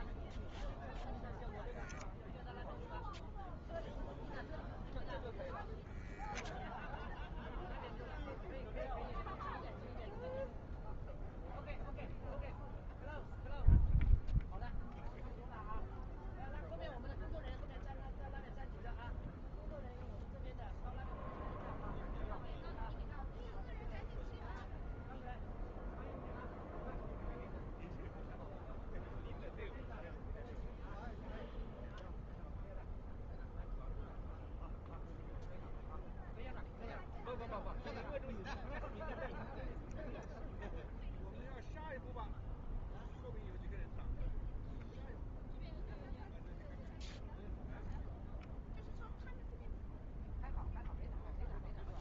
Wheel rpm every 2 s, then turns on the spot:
0, 0, 0, 0, 0, 0, 0, 0, 0, 0, 0, 0, 0, 0, 0, 0, 0, 0, 0, 0, 0, 0, 0, 0, 0, 0.
none